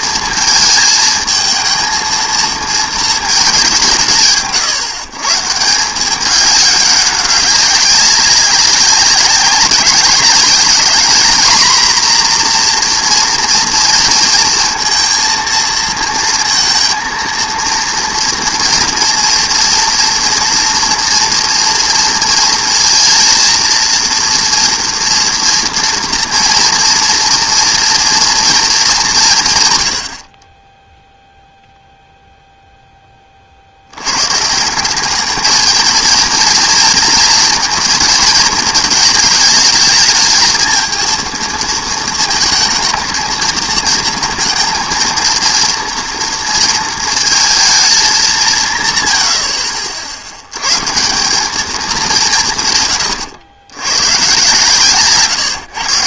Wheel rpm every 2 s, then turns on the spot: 230, 230, 150, 200, 190, 210, 240, 230, 230, 230, 230, 230, 230, 240, 220, 30, 0, 160, 230, 220, 220, 220, 230, 230, 160, 120, 140, 130.
none